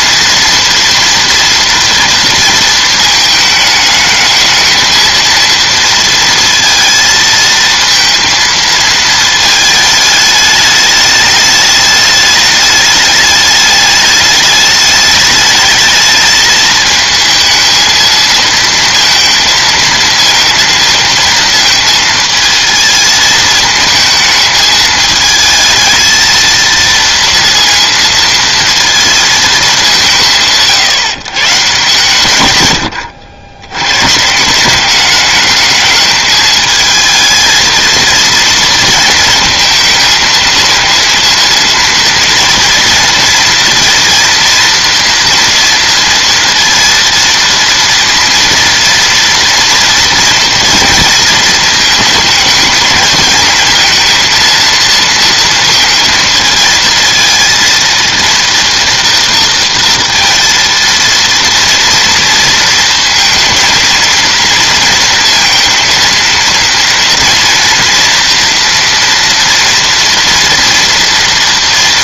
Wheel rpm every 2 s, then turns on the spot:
230, 230, 220, 230, 220, 210, 210, 210, 220, 230, 230, 220, 220, 220, 230, 160, 110, 180, 220, 230, 220, 230, 230, 230, 230, 230, 220, 230, 220, 230, 230, 230, 230, 230, 230, 230.
none